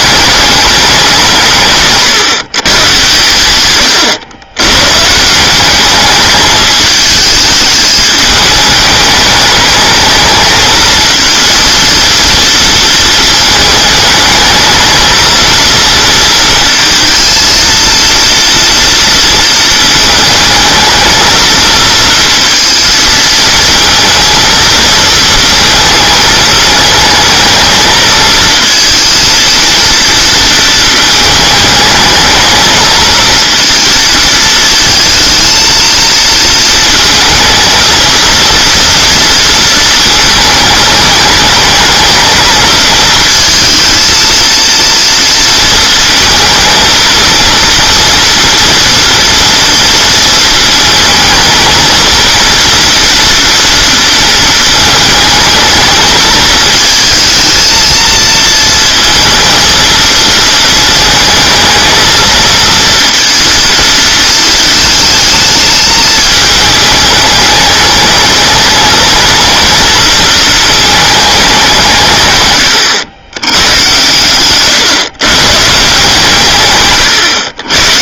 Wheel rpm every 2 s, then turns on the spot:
200, 130, 120, 220, 210, 220, 230, 220, 230, 230, 220, 230, 230, 220, 230, 230, 220, 220, 230, 230, 220, 220, 230, 220, 230, 220, 230, 220, 220, 230, 220, 230, 220, 210, 220, 220, 120, 140, 140.
74-76